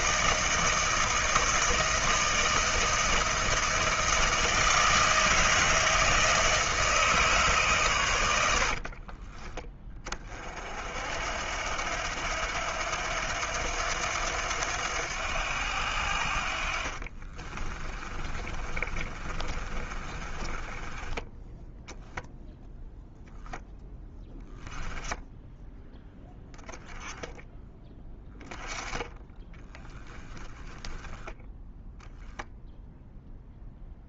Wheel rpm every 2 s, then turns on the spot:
160, 160, 160, 150, 50, 60, 80, 90, 50, 30, 20, 0, 10, 10, 10, 10, 0.
8-10 16-22